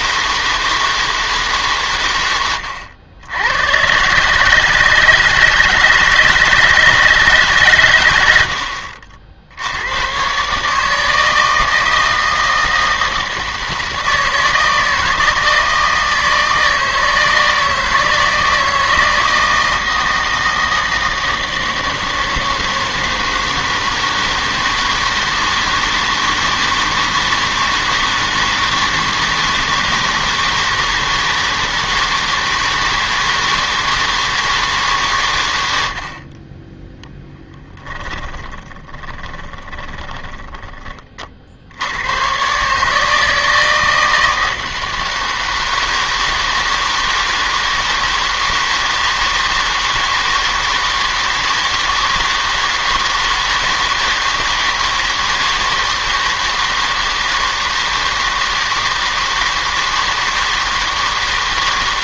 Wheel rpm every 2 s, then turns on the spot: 160, 100, 150, 160, 80, 150, 160, 160, 160, 160, 160, 160, 160, 160, 160, 160, 160, 160, 20, 10, 20, 140, 160, 160, 160, 160, 160, 160, 160, 160, 160.
38-40